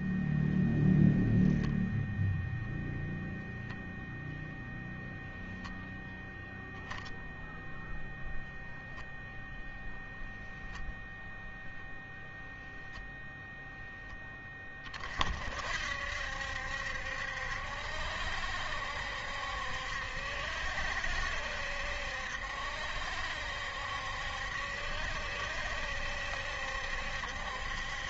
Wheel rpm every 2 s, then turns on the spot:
0, 0, 0, 0, 0, 0, 0, 30, 70, 70, 70, 70, 70, 70.
none